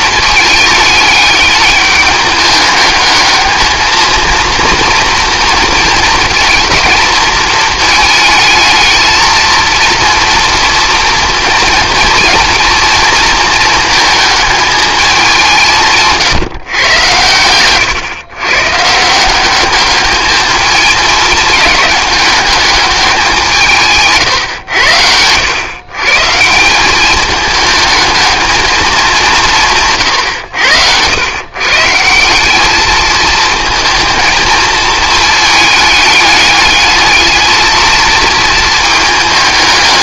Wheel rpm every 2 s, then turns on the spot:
210, 210, 230, 220, 220, 240, 230, 220, 120, 150, 220, 210, 100, 190, 210, 90, 210, 220, 210, 220.
none